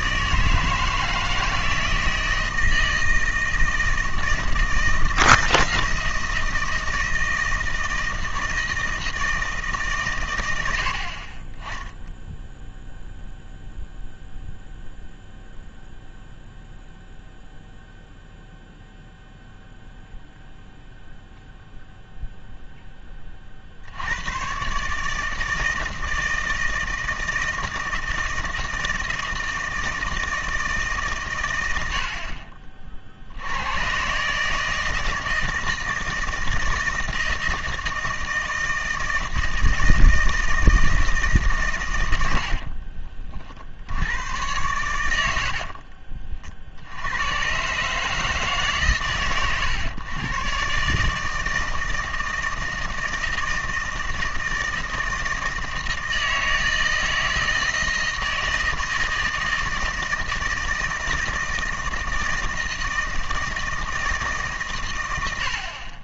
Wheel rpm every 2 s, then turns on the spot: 160, 160, 160, 160, 160, 90, 0, 0, 0, 0, 0, 10, 130, 160, 160, 150, 40, 160, 160, 160, 160, 50, 100, 60, 140, 140, 160, 160, 160, 160, 160, 160, 130.
42-44